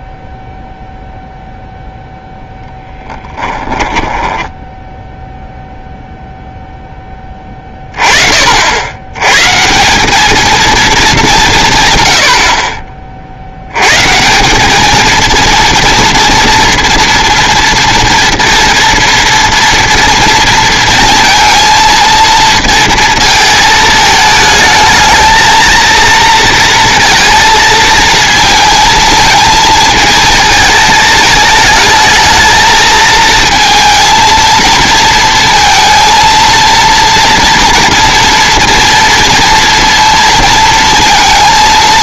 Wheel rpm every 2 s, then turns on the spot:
0, 10, 10, 0, 60, 220, 50, 210, 230, 230, 230, 230, 220, 230, 220, 220, 220, 230, 230, 230, 230.
none